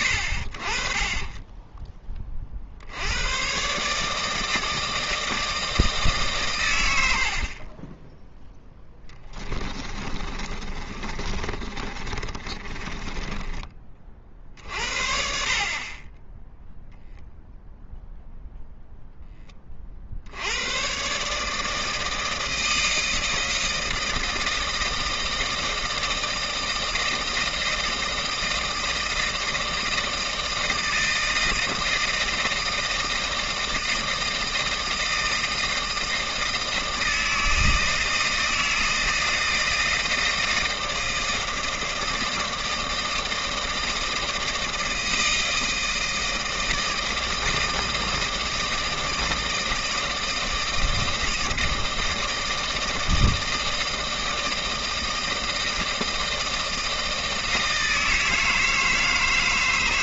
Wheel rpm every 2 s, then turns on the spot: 50, 60, 160, 100, 10, 30, 30, 50, 0, 0, 100, 160, 160, 160, 160, 160, 160, 160, 160, 160, 160, 160, 160, 160, 160, 160, 160, 160, 160, 160.
8-14